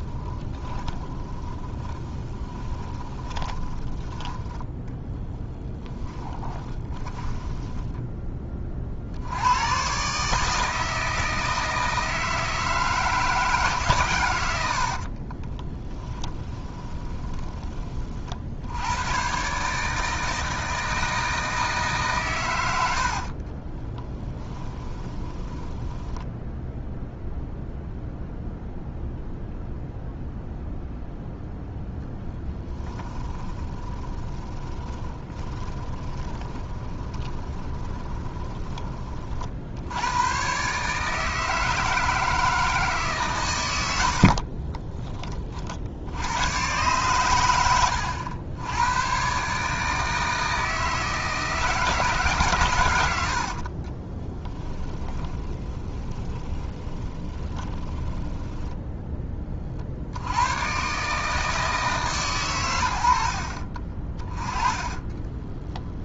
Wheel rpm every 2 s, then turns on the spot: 10, 20, 10, 20, 50, 160, 160, 60, 10, 100, 160, 80, 20, 0, 0, 0, 20, 20, 20, 30, 150, 150, 20, 120, 110, 160, 100, 20, 20, 10, 120, 100, 20.
0-8 14-18 24-26 32-38 54-60 64-66